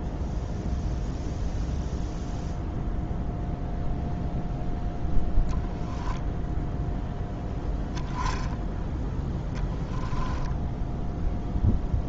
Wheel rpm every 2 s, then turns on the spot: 0, 0, 0, 10, 10, 0.
none